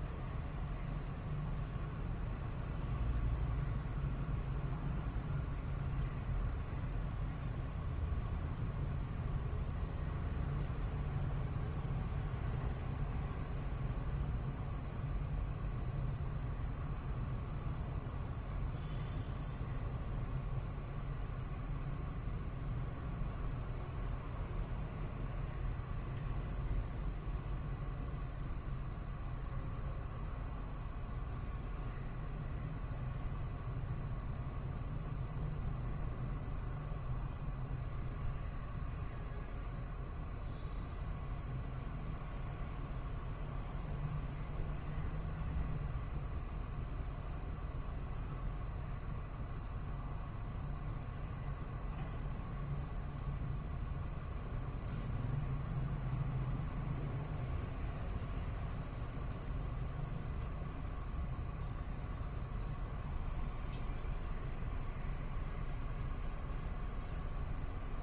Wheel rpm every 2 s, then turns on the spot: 0, 0, 0, 0, 0, 0, 0, 0, 0, 0, 0, 0, 0, 0, 0, 0, 0, 0, 0, 0, 0, 0, 0, 0, 0, 0, 0, 0, 0, 0, 0, 0, 0, 0.
none